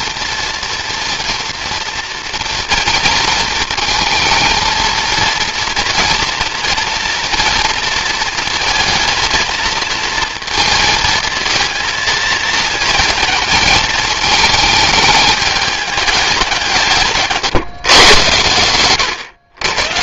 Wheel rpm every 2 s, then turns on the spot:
230, 230, 230, 230, 230, 230, 220, 220, 180, 110.
none